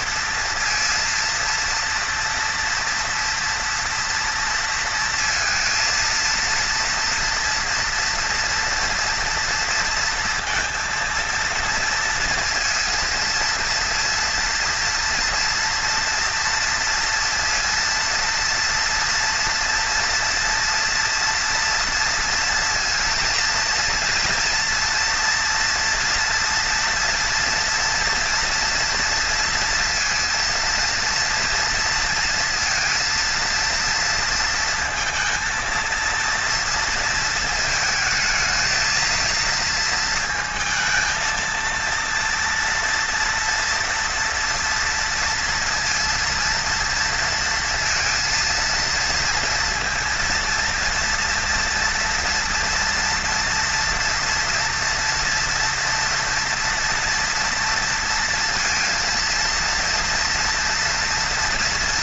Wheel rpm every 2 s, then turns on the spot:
230, 230, 230, 230, 230, 230, 230, 230, 230, 230, 230, 230, 230, 240, 230, 230, 230, 230, 230, 220, 220, 230, 230, 230, 230, 230, 230, 230, 230, 230, 230.
none